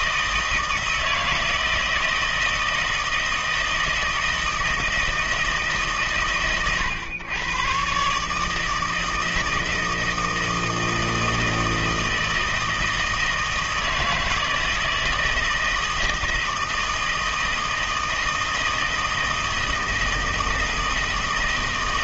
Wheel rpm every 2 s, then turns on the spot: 160, 160, 160, 130, 150, 160, 160, 160, 160, 160, 160.
none